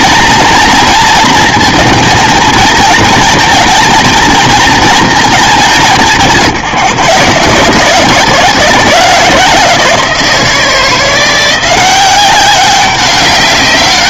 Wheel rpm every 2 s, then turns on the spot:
230, 230, 230, 160, 160, 170, 190.
none